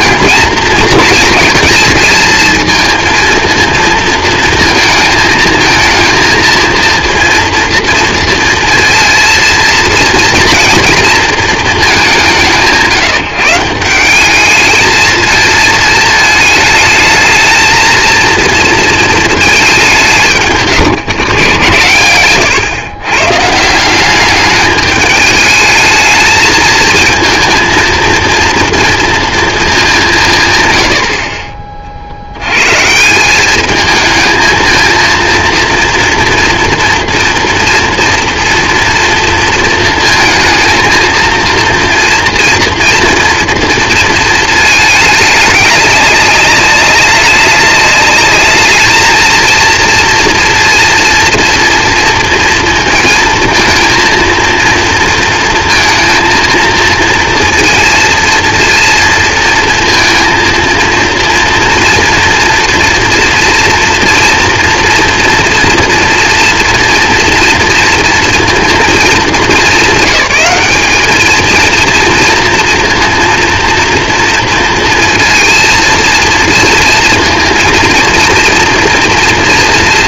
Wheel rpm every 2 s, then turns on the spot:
220, 220, 230, 230, 230, 230, 150, 210, 220, 230, 160, 120, 210, 220, 230, 120, 120, 230, 230, 230, 220, 240, 220, 200, 210, 240, 230, 230, 230, 230, 230, 240, 230, 230, 220, 200, 230, 230, 230, 230.
none